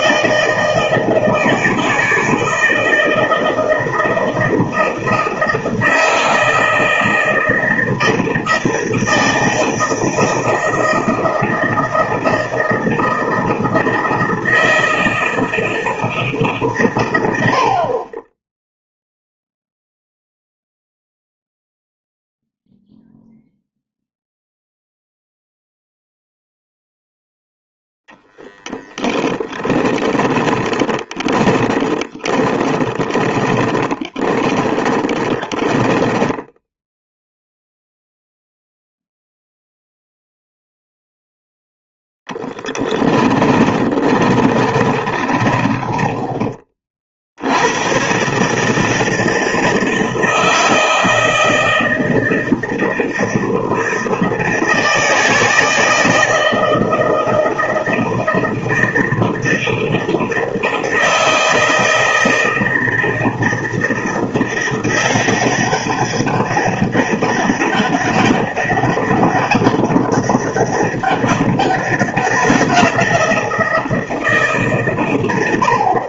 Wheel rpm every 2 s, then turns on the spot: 160, 160, 160, 160, 160, 160, 160, 160, 140, 0, 0, 0, 0, 0, 0, 10, 20, 10, 0, 0, 0, 20, 30, 40, 150, 160, 160, 160, 160, 160, 160, 160, 170, 200, 200, 200, 180, 140.
30-36 42-46